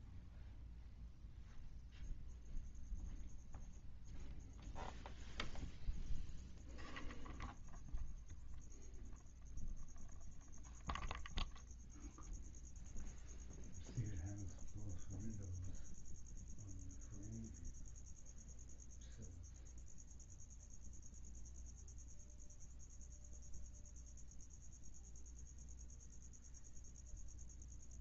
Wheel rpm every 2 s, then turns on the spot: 0, 0, 0, 0, 0, 0, 0, 0, 0, 0, 0, 0, 0, 0.
none